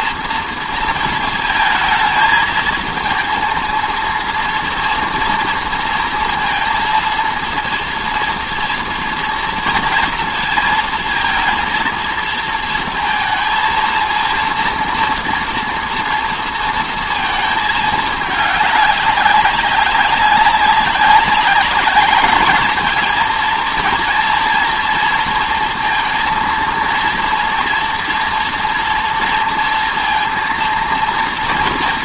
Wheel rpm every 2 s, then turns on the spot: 230, 220, 230, 230, 230, 230, 230, 230, 230, 210, 200, 220, 230, 230, 230, 230.
none